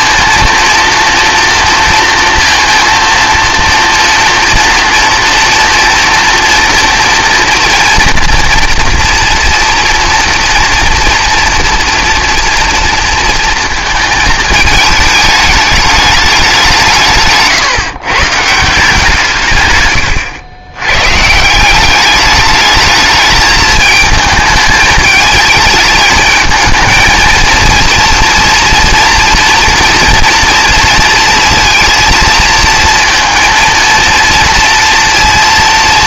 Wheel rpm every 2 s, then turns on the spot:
230, 230, 240, 240, 230, 230, 230, 220, 180, 160, 110, 210, 220, 220, 230, 230, 230, 230.
none